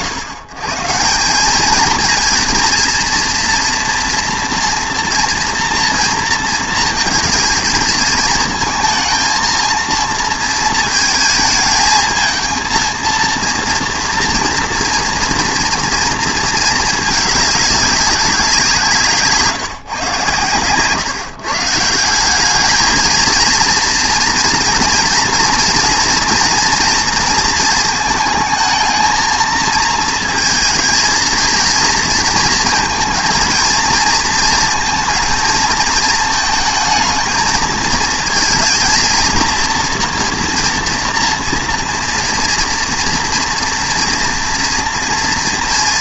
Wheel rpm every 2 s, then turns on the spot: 130, 230, 230, 230, 220, 230, 230, 230, 210, 160, 130, 220, 230, 230, 220, 220, 230, 230, 220, 230, 230, 230, 230.
20-22